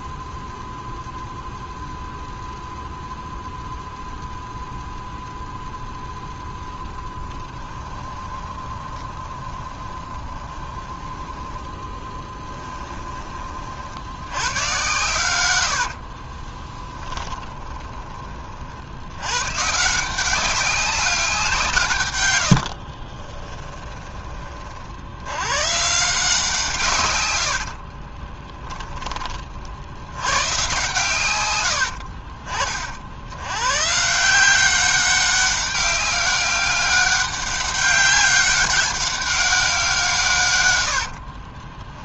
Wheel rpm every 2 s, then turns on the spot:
0, 0, 0, 20, 20, 10, 10, 120, 20, 70, 190, 40, 70, 140, 20, 130, 50, 190, 200, 200, 70.
6-12 16-18 22-24 40-42